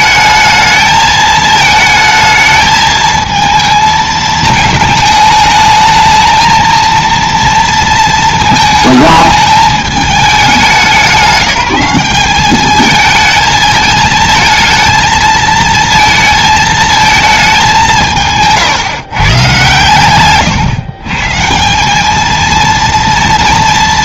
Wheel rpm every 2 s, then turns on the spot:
220, 220, 220, 230, 220, 190, 210, 230, 220, 160, 130, 230.
none